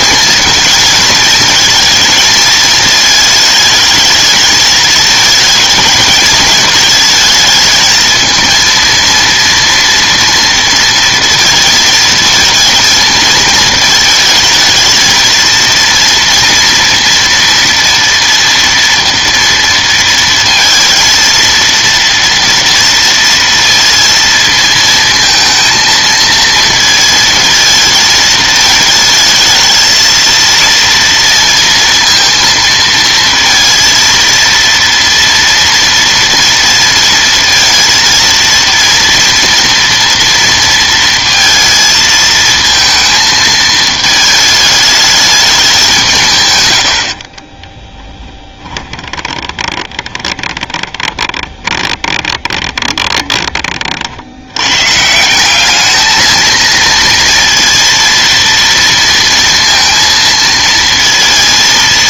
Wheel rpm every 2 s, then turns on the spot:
220, 220, 220, 220, 230, 230, 230, 220, 230, 230, 230, 230, 230, 220, 220, 230, 230, 230, 230, 230, 230, 220, 220, 130, 30, 20, 20, 90, 230, 230, 230.
48-54